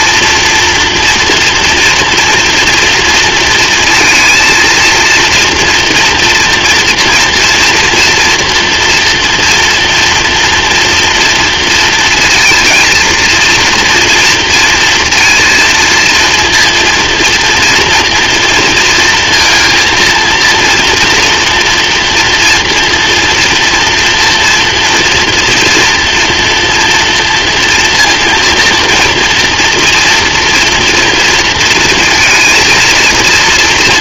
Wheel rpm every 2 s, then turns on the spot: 240, 230, 230, 230, 230, 240, 230, 230, 230, 230, 230, 230, 230, 240, 240, 240, 230.
none